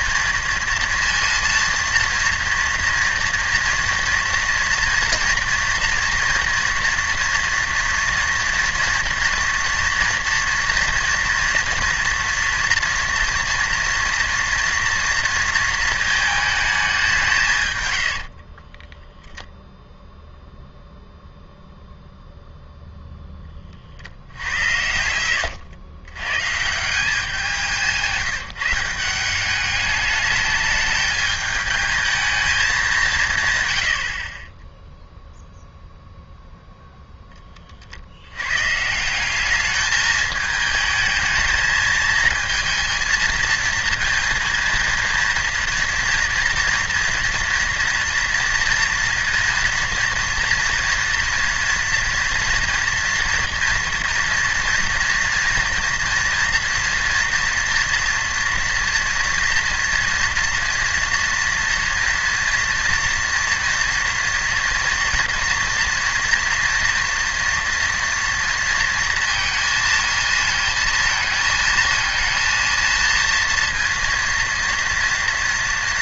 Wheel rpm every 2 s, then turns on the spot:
230, 230, 230, 230, 230, 230, 240, 230, 210, 30, 0, 0, 80, 150, 170, 210, 200, 20, 0, 120, 220, 220, 230, 240, 230, 230, 230, 230, 230, 230, 240, 230, 230, 240, 230, 220, 230, 230.
18-20 34-36